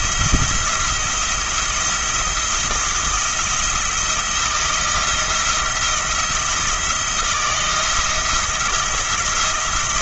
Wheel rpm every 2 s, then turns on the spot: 170, 170, 170, 170, 170.
none